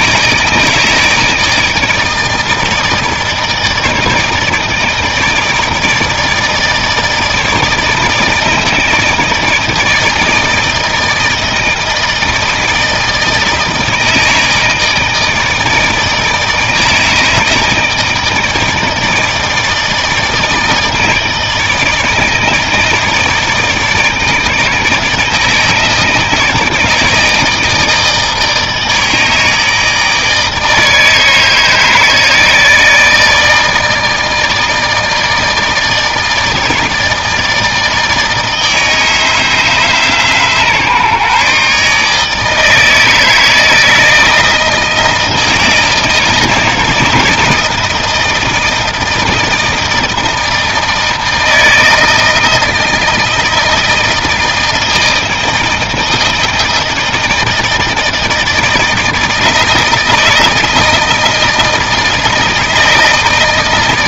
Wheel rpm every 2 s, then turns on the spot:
160, 160, 160, 160, 160, 160, 160, 160, 160, 160, 160, 160, 160, 160, 160, 160, 160, 160, 160, 160, 150, 150, 160, 160, 170, 160, 160, 160, 160, 160, 160, 160.
none